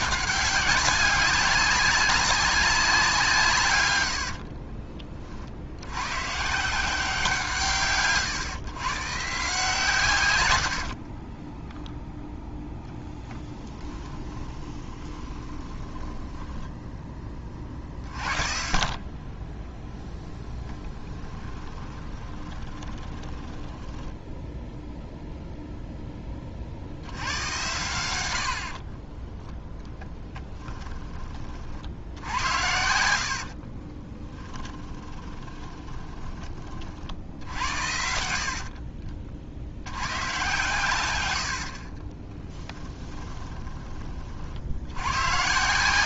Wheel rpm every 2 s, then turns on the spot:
200, 190, 50, 170, 130, 80, 10, 20, 10, 50, 20, 20, 0, 50, 60, 10, 80, 20, 40, 60, 110, 20, 80.
4-6 10-12 14-18 20-24 28-30 32-36 38-40 42-44